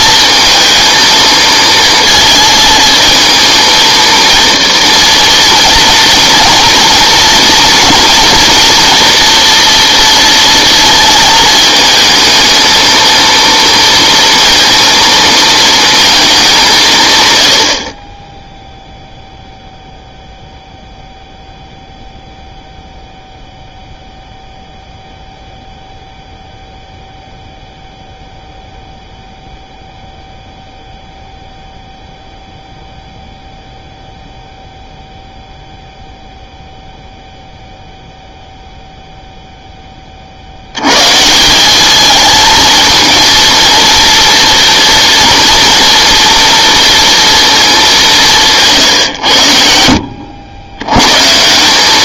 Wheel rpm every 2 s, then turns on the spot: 220, 230, 230, 230, 240, 220, 230, 230, 180, 0, 0, 0, 0, 0, 0, 0, 0, 0, 0, 0, 80, 220, 230, 240, 170, 100.
none